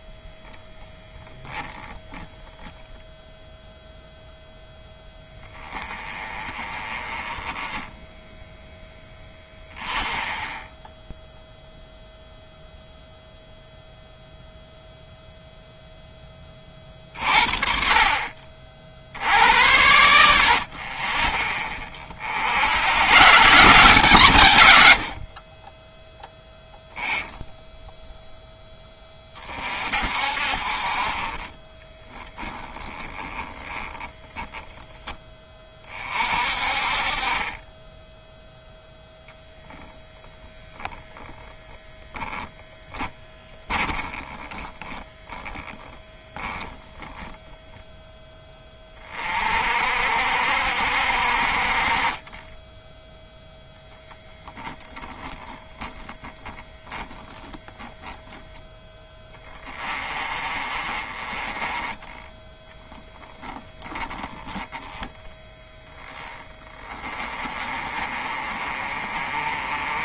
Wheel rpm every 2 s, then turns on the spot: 0, 0, 0, 20, 10, 10, 0, 0, 30, 60, 40, 110, 90, 10, 20, 30, 10, 10, 40, 0, 10, 10, 10, 0, 30, 60, 10, 0, 10, 10, 30, 10, 10, 40, 30.
32-34 42-46